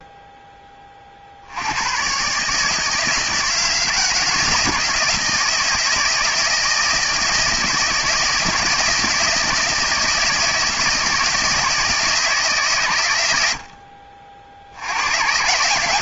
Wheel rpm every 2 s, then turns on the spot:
10, 150, 160, 160, 160, 160, 150, 70.
none